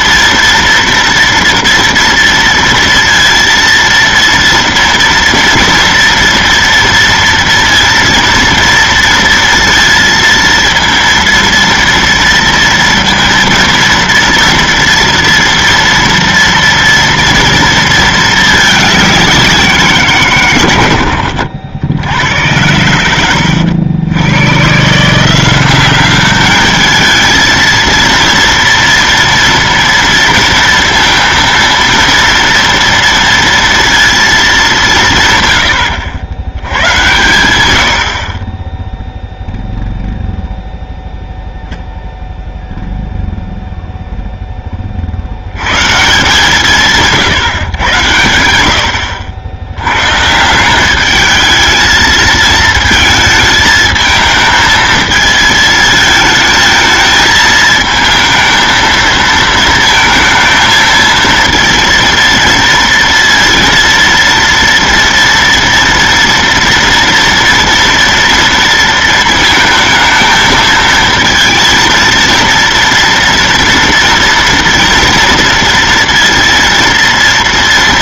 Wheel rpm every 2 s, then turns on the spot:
230, 230, 230, 230, 230, 230, 230, 230, 230, 210, 120, 90, 110, 210, 230, 230, 230, 210, 100, 30, 0, 0, 10, 170, 80, 180, 220, 220, 220, 220, 220, 230, 230, 240, 230, 220, 230, 230, 230.
none